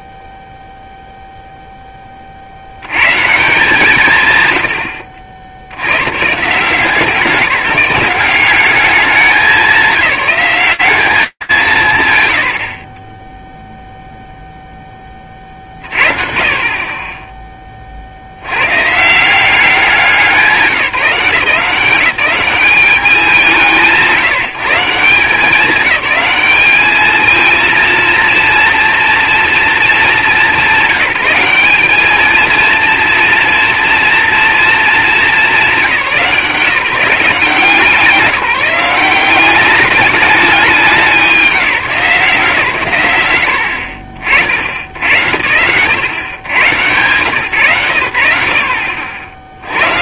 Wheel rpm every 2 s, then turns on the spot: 0, 130, 90, 170, 200, 180, 10, 30, 30, 140, 180, 180, 170, 210, 230, 200, 230, 220, 160, 180, 190, 150, 80, 110, 20.
none